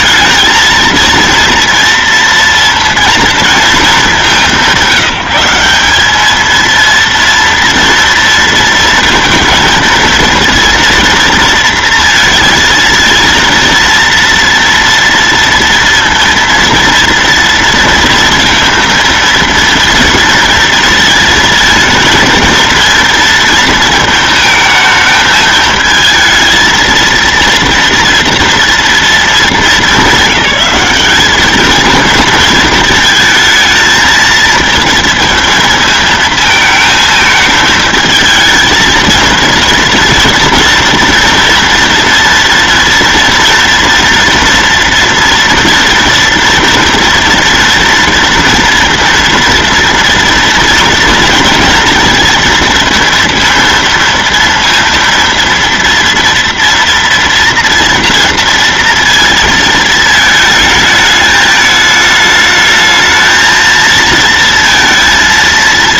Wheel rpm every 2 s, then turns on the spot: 230, 230, 190, 230, 230, 230, 230, 240, 230, 230, 230, 230, 220, 230, 230, 200, 220, 220, 220, 220, 240, 240, 230, 230, 230, 230, 230, 230, 230, 230, 220, 220, 230.
none